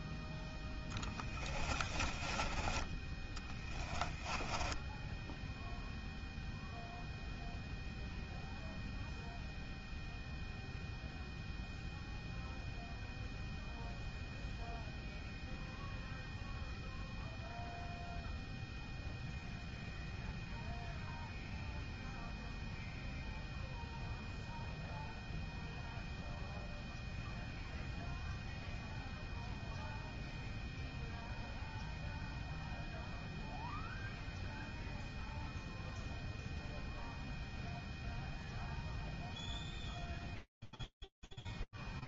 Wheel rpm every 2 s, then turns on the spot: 10, 20, 10, 0, 0, 0, 0, 0, 0, 0, 0, 0, 0, 0, 0, 0, 0, 0, 0, 0, 0.
4-6